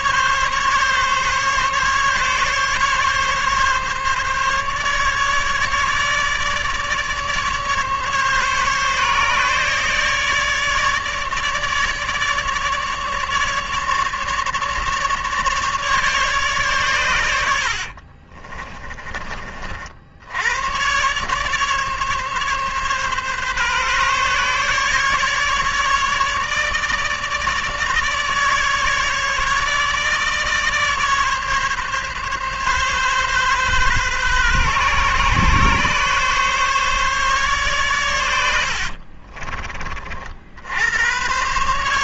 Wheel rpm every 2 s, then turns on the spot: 140, 140, 150, 150, 140, 150, 150, 150, 100, 30, 130, 140, 150, 150, 150, 140, 140, 130, 140, 40, 100.
38-40